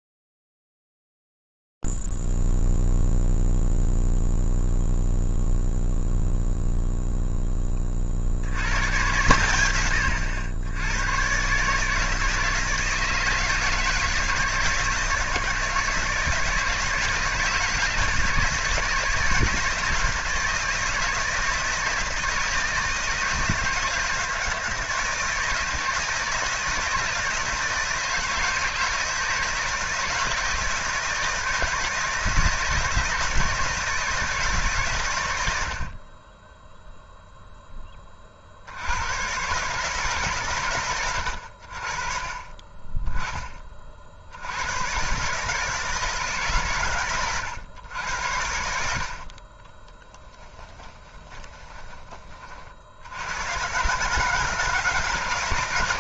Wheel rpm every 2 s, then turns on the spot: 0, 0, 0, 0, 40, 100, 160, 160, 150, 160, 160, 160, 160, 160, 160, 160, 160, 150, 10, 70, 120, 20, 100, 130, 70, 10, 40, 160.
48-52